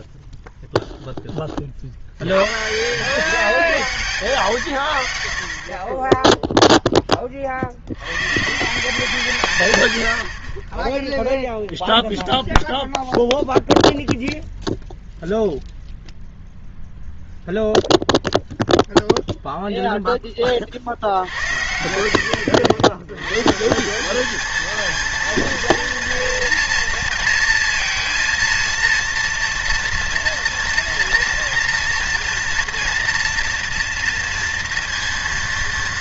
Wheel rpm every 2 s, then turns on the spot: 0, 130, 110, 0, 150, 20, 0, 0, 0, 0, 40, 80, 220, 230, 230, 230, 230, 230.
10-12